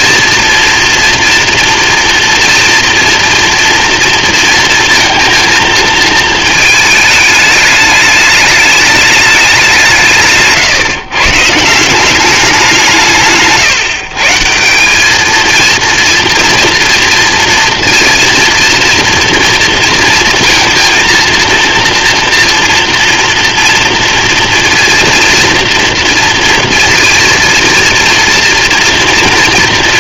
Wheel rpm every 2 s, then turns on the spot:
230, 230, 230, 210, 200, 150, 150, 210, 240, 240, 230, 230, 230, 230, 230.
none